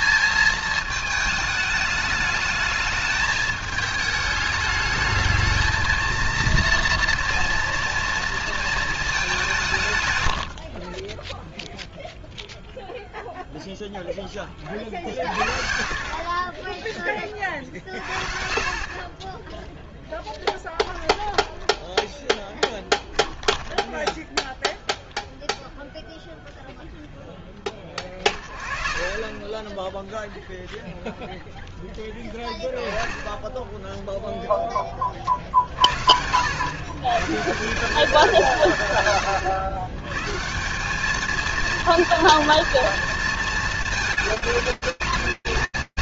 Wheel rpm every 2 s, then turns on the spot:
210, 220, 230, 190, 10, 0, 50, 30, 20, 10, 10, 0, 10, 10, 0, 0, 50, 170, 100, 220, 230, 220, 200.
18-20